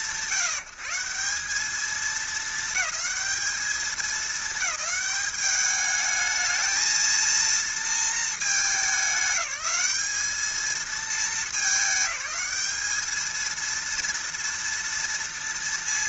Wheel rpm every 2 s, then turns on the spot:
160, 210, 210, 230, 210, 220, 210, 230.
none